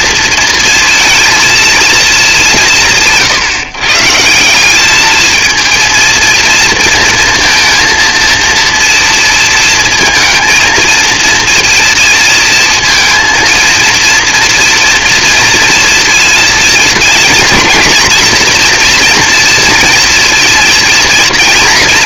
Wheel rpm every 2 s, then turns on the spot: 230, 190, 180, 230, 230, 230, 230, 230, 220, 230, 230.
none